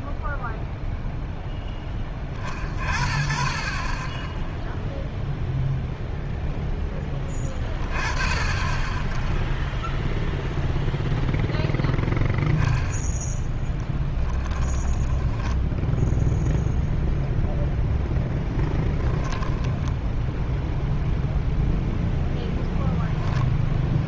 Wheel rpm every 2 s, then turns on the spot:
0, 40, 0, 0, 10, 0, 0, 20, 0, 10, 0, 10.
14-16 22-24